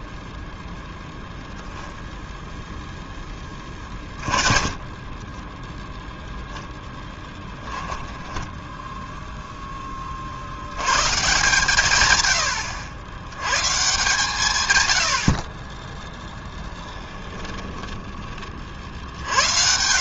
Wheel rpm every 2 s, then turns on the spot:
0, 0, 20, 10, 0, 100, 90, 90, 10, 50.
4-6 16-18